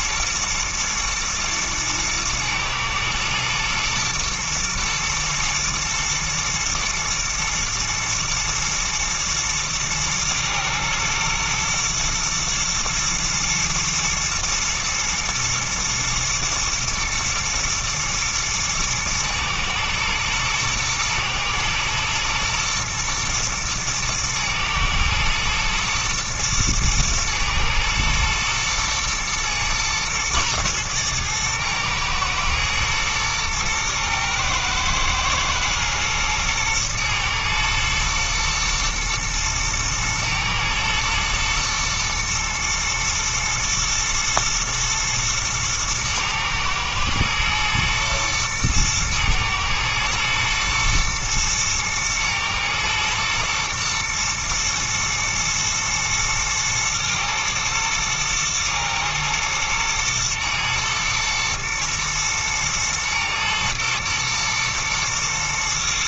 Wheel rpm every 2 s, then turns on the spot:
120, 110, 110, 120, 110, 120, 120, 120, 110, 110, 110, 120, 110, 110, 110, 110, 110, 110, 120, 120, 110, 110, 120, 110, 110, 120, 120, 120, 110, 110, 110, 110, 120.
none